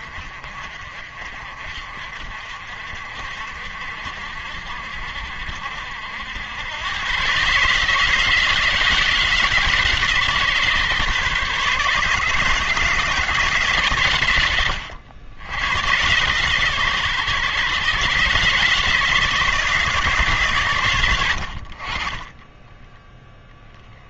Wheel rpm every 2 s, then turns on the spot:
50, 60, 60, 110, 160, 140, 160, 90, 130, 150, 110, 10.
none